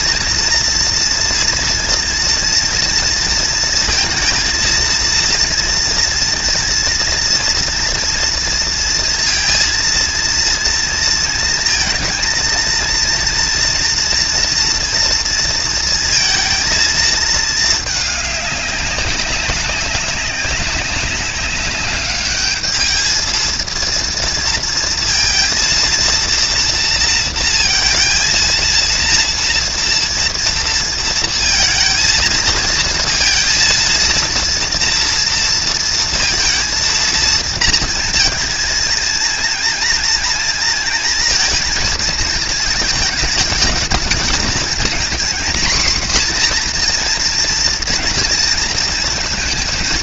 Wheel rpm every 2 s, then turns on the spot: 230, 230, 230, 230, 230, 230, 230, 240, 230, 200, 190, 210, 230, 230, 230, 230, 230, 230, 230, 220, 230, 220, 230, 240, 230.
none